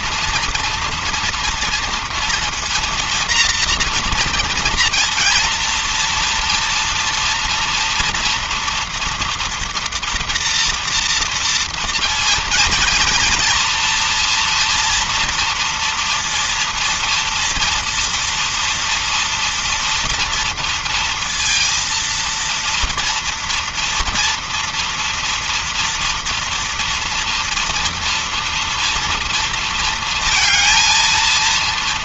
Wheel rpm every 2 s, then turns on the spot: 230, 230, 240, 230, 240, 230, 230, 230, 230, 230, 230, 230, 230, 240, 240, 230.
none